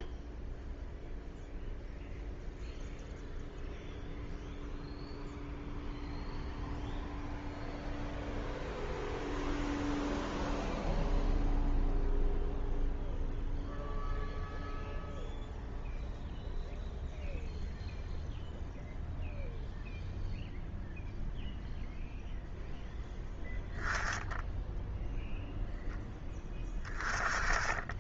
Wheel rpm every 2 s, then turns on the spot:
0, 0, 0, 0, 0, 0, 0, 0, 0, 0, 0, 0, 0, 20.
none